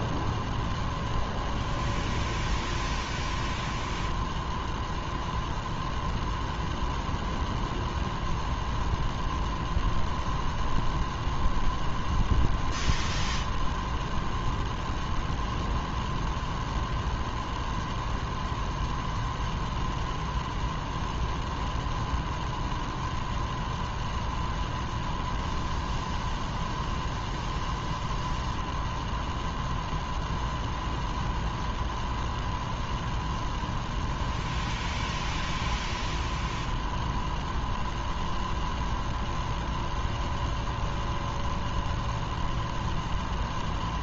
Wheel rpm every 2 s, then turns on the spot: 0, 0, 0, 0, 0, 0, 0, 0, 0, 0, 0, 0, 0, 0, 0, 0, 0, 0, 0, 0, 0, 0.
none